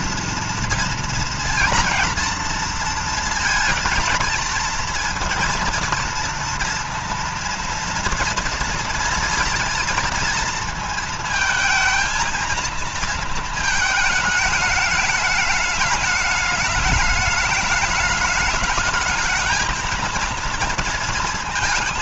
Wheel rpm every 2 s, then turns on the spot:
230, 230, 230, 230, 230, 230, 230, 210, 210, 210, 230.
none